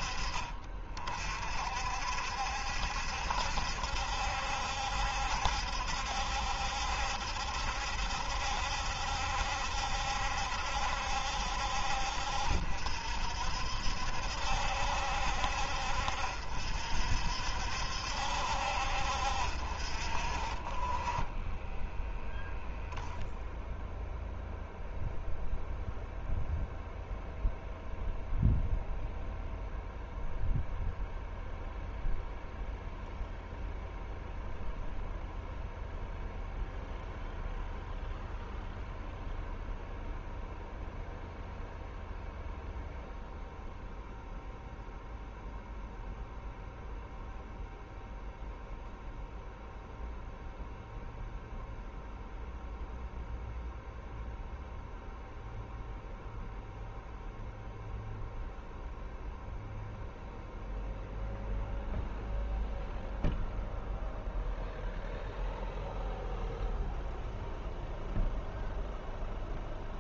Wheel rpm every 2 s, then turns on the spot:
40, 70, 70, 70, 70, 70, 60, 70, 60, 60, 30, 0, 0, 0, 0, 0, 0, 0, 0, 0, 0, 0, 0, 0, 0, 0, 0, 0, 0, 0, 0, 0, 0, 0, 0.
none